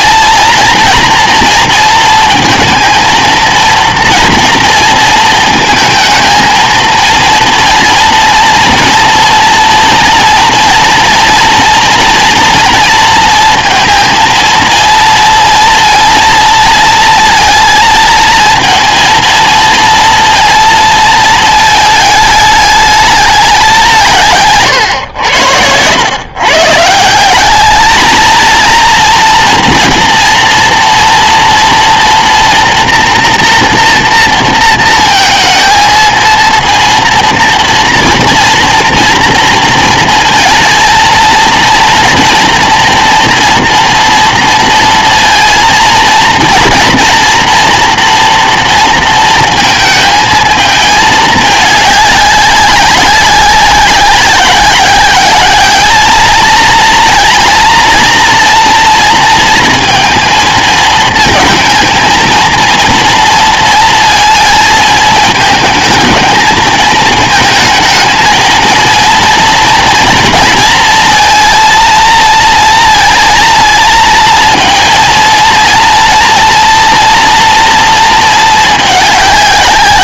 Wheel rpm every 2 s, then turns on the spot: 230, 230, 230, 230, 230, 230, 230, 230, 230, 230, 230, 210, 140, 140, 230, 230, 230, 230, 230, 230, 220, 240, 230, 230, 230, 220, 200, 190, 220, 230, 230, 230, 220, 220, 230, 230, 230, 230, 230, 210.
none